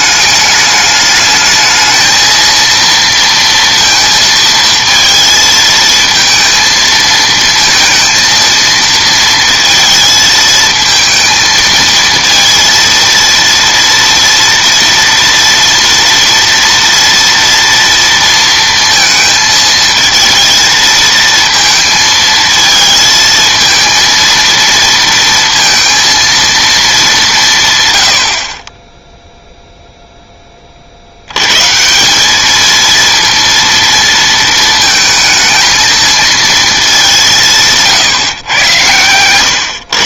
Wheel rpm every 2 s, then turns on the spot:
210, 230, 230, 220, 220, 220, 230, 230, 230, 230, 230, 220, 230, 220, 40, 20, 220, 230, 210, 110.
none